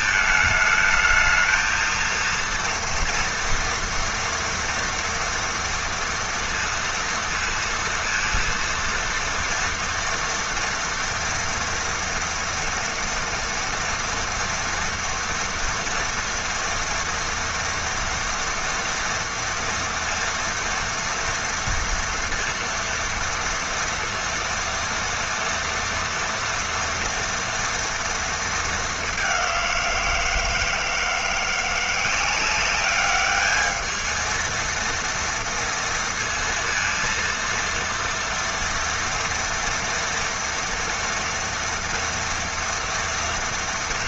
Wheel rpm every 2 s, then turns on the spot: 220, 230, 230, 230, 230, 240, 230, 230, 230, 230, 230, 230, 230, 230, 200, 160, 200, 230, 230, 230, 230, 230.
none